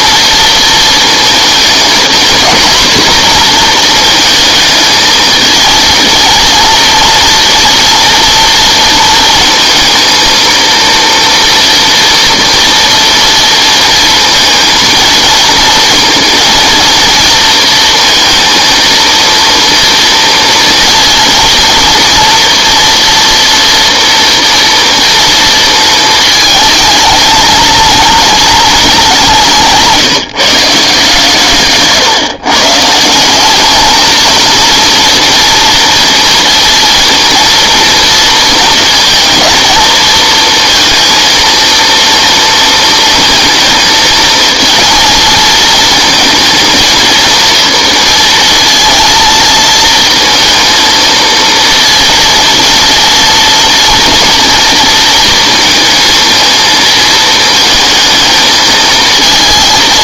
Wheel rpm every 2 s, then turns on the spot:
220, 240, 220, 230, 230, 230, 240, 230, 230, 230, 230, 240, 230, 220, 200, 160, 150, 230, 230, 230, 230, 230, 230, 230, 230, 230, 230, 230, 220, 220.
none